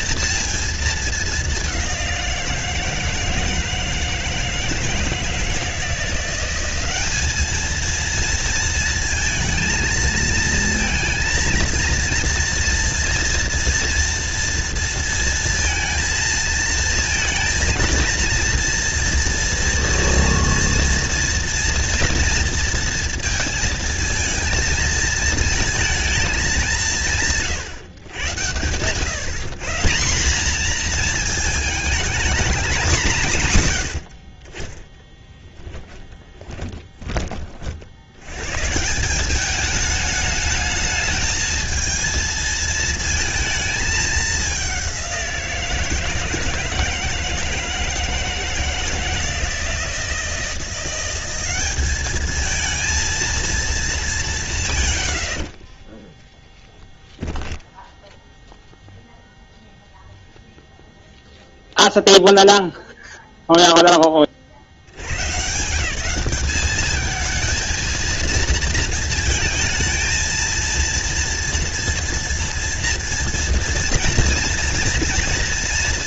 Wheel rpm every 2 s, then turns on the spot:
220, 170, 160, 190, 230, 230, 230, 230, 220, 230, 230, 230, 230, 190, 110, 220, 200, 20, 20, 130, 210, 220, 200, 160, 160, 170, 230, 140, 10, 0, 0, 0, 60, 210, 230, 230, 230, 230.
36-38 56-58